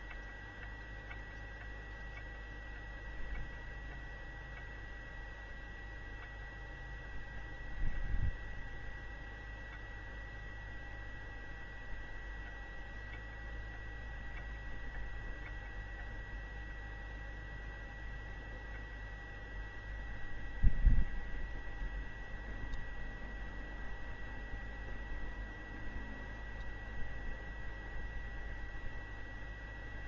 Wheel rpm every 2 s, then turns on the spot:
0, 0, 0, 0, 0, 0, 0, 0, 0, 0, 0, 0, 0, 0, 0.
none